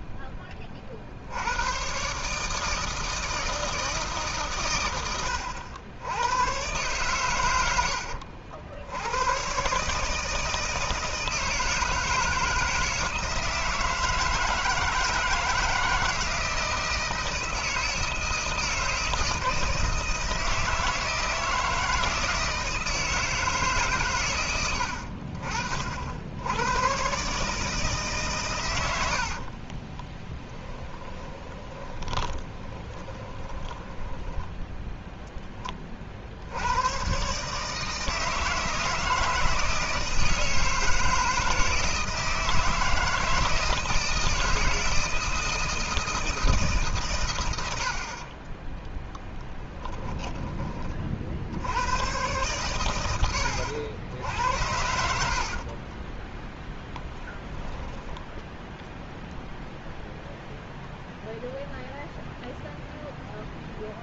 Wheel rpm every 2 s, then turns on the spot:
40, 160, 110, 110, 90, 160, 160, 160, 160, 160, 160, 160, 80, 120, 90, 10, 20, 10, 110, 160, 160, 160, 160, 140, 10, 30, 110, 80, 10, 0, 0, 0.
28-34 48-50 54-58